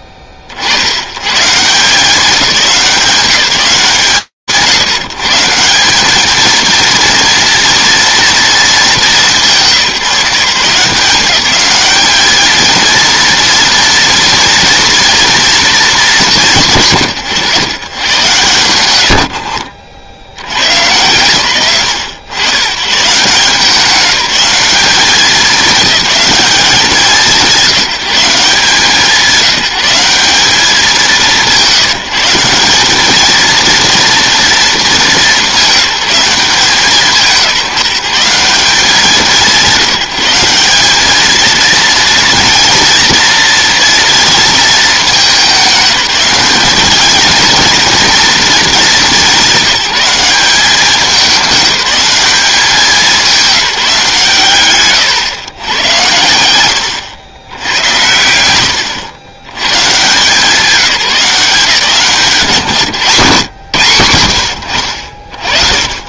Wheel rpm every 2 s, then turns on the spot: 60, 180, 140, 230, 220, 170, 220, 230, 160, 110, 140, 130, 200, 200, 170, 190, 190, 220, 160, 190, 190, 230, 220, 200, 210, 200, 200, 140, 120, 110, 180, 140, 80.
none